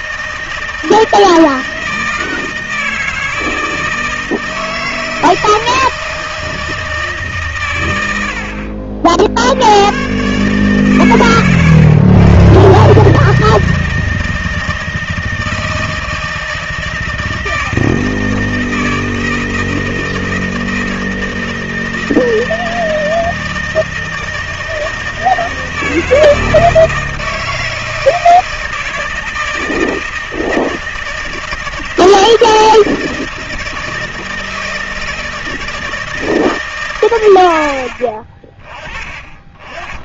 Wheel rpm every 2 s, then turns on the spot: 160, 160, 160, 160, 60, 140, 130, 160, 160, 160, 160, 160, 160, 160, 160, 160, 160, 160, 150, 30.
none